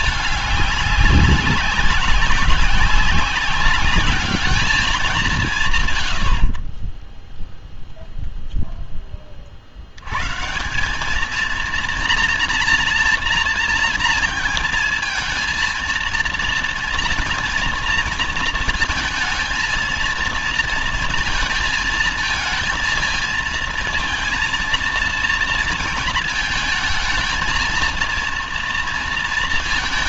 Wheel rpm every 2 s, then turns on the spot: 200, 190, 210, 50, 0, 140, 230, 230, 230, 230, 230, 230, 230, 230, 230.
none